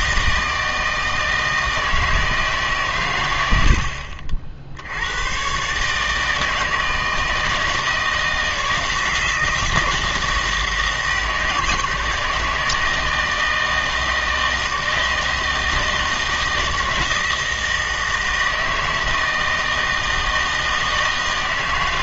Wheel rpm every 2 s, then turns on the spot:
160, 140, 70, 160, 170, 160, 160, 160, 160, 160, 160.
none